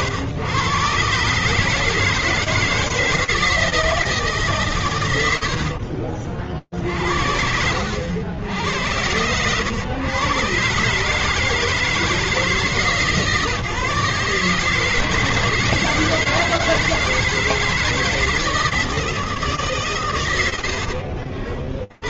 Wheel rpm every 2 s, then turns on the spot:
110, 160, 150, 60, 90, 140, 150, 150, 160, 160, 60.
20-22